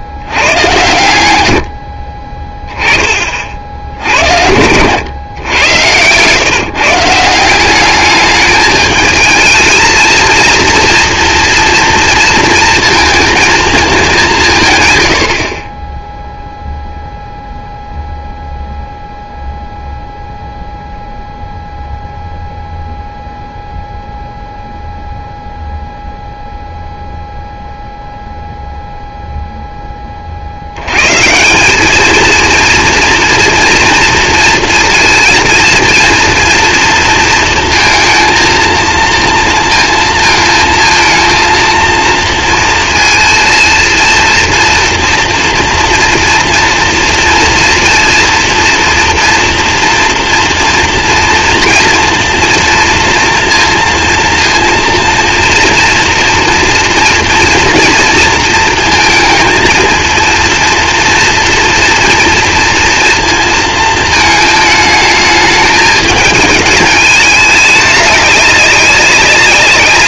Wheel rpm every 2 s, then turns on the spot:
100, 20, 90, 140, 210, 230, 230, 140, 0, 0, 0, 0, 0, 0, 0, 80, 230, 230, 230, 230, 230, 230, 230, 230, 230, 230, 230, 230, 230, 230, 230, 230, 220, 220, 200.
none